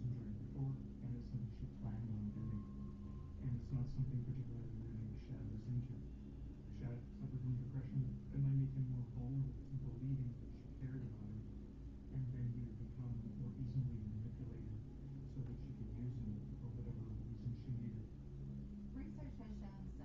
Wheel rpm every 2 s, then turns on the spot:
0, 0, 0, 0, 0, 0, 0, 0, 0, 0.
none